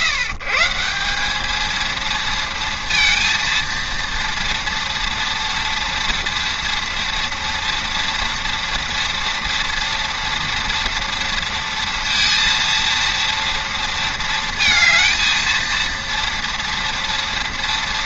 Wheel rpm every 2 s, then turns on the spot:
150, 230, 230, 230, 240, 230, 230, 220, 230.
none